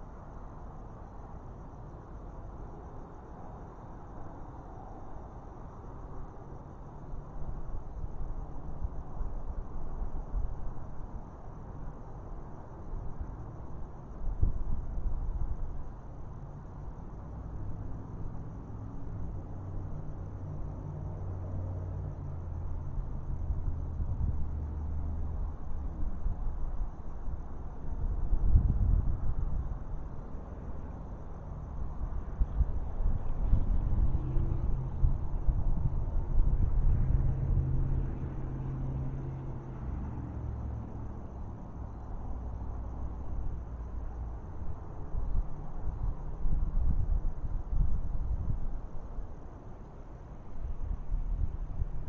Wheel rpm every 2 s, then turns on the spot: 0, 0, 0, 0, 0, 0, 0, 0, 0, 0, 0, 0, 0, 0, 0, 0, 0, 0, 0, 0, 0, 0, 0, 0, 0, 0.
none